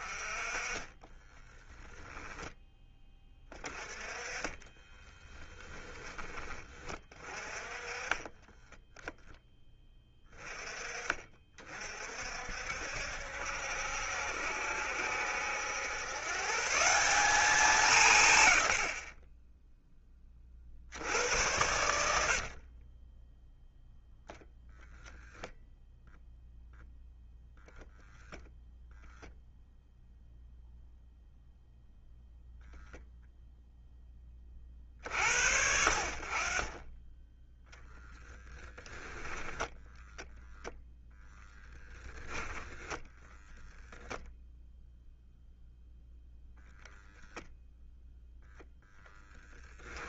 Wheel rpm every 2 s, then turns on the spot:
20, 10, 20, 30, 10, 30, 60, 70, 170, 60, 70, 30, 10, 0, 0, 0, 0, 40, 20, 10, 0, 10, 0, 0, 0.
0-2 4-6 22-24 38-40